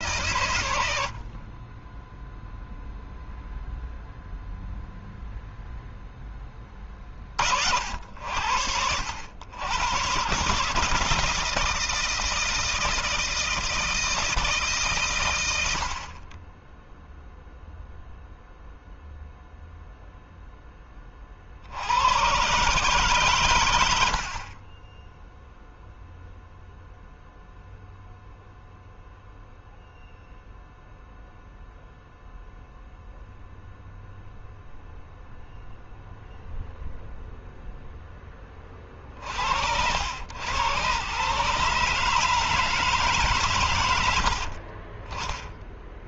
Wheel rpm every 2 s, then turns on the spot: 90, 0, 0, 20, 80, 150, 160, 150, 20, 0, 20, 140, 20, 0, 0, 0, 0, 0, 0, 20, 110, 150, 50.
none